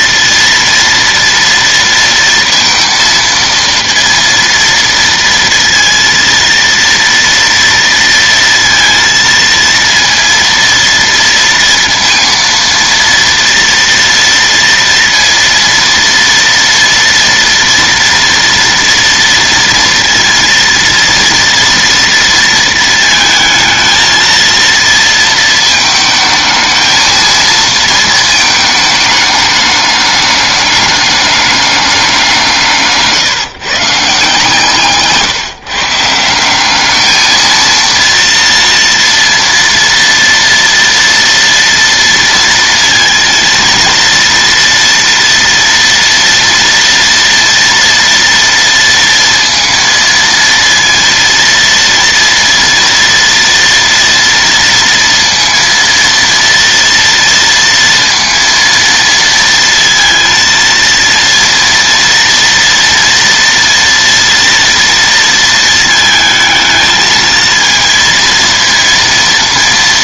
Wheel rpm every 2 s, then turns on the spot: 230, 230, 230, 230, 230, 230, 230, 230, 230, 230, 230, 220, 230, 220, 220, 210, 160, 140, 190, 230, 230, 230, 230, 230, 230, 230, 230, 230, 230, 230, 230, 230, 230, 220, 230.
none